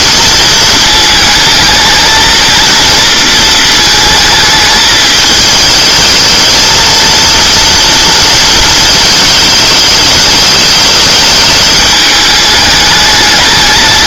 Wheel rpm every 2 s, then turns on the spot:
220, 230, 210, 220, 220, 210, 210.
none